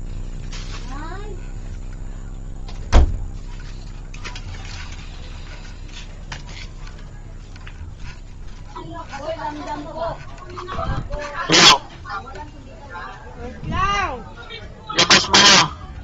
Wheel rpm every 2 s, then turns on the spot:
0, 0, 0, 0, 0, 0, 0, 0.
none